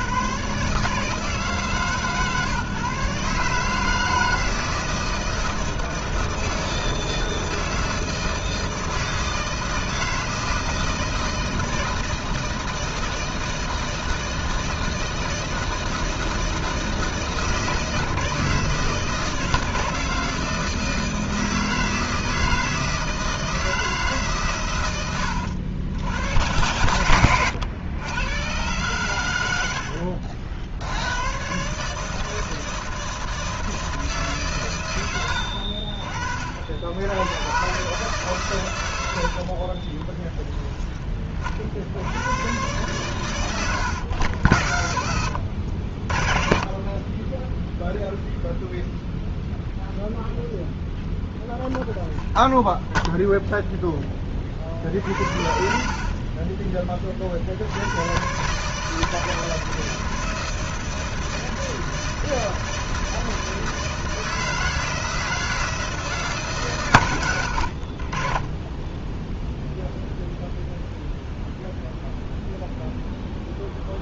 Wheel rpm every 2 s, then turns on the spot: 150, 150, 160, 160, 160, 160, 160, 160, 160, 160, 160, 160, 100, 110, 110, 100, 160, 110, 80, 90, 20, 110, 90, 30, 0, 0, 0, 60, 30, 160, 160, 160, 160, 120, 10, 0, 0.
54-56 68-70